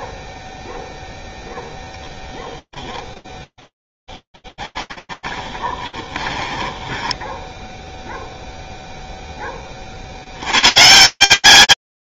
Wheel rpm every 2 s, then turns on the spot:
0, 0, 10, 20, 0, 80.
4-8